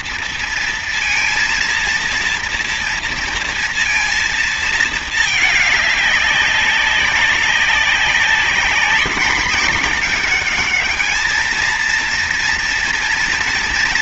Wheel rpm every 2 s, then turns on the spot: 230, 230, 230, 200, 200, 210, 230.
none